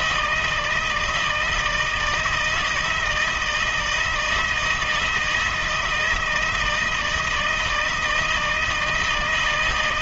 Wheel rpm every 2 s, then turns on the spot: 160, 160, 170, 160, 160.
none